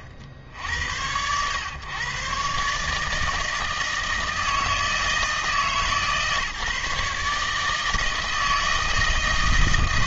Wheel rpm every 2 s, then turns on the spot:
60, 140, 160, 150, 160.
none